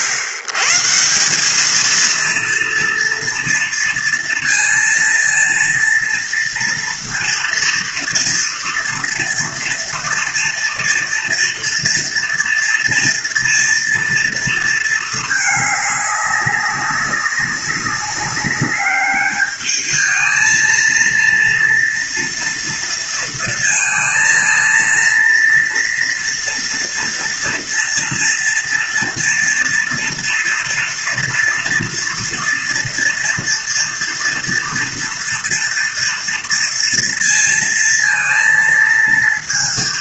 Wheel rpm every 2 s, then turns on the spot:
110, 230, 230, 230, 230, 230, 230, 230, 200, 200, 220, 230, 230, 230, 240, 230, 230, 230, 230, 230.
none